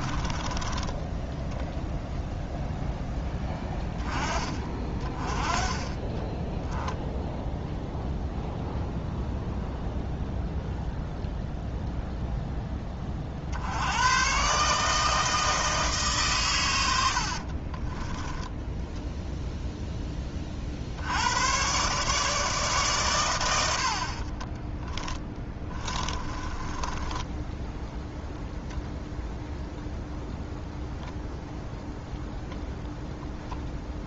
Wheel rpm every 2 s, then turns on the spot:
10, 0, 30, 0, 0, 0, 10, 150, 110, 10, 50, 140, 10, 20, 0, 0, 0.
0-2 24-28